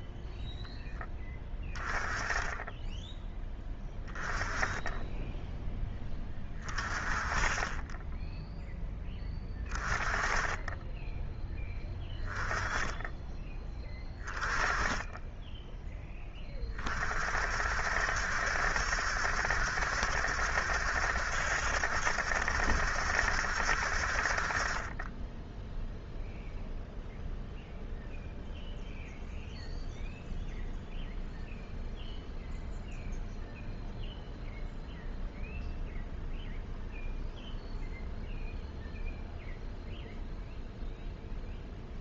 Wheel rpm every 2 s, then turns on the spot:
10, 10, 10, 20, 10, 10, 10, 20, 30, 70, 70, 70, 30, 0, 0, 0, 0, 0, 0, 0, 0.
none